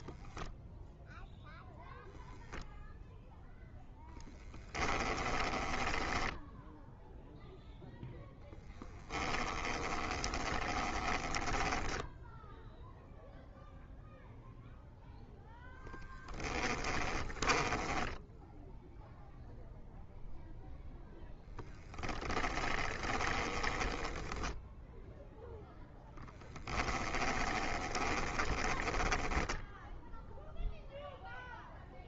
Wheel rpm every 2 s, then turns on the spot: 0, 0, 10, 10, 0, 20, 0, 0, 10, 10, 0, 10, 10, 10, 20, 0.
4-8 10-12 16-20 22-26 28-30